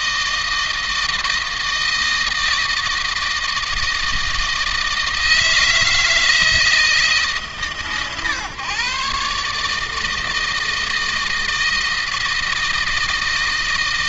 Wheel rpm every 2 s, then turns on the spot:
160, 160, 160, 160, 140, 160, 160.
none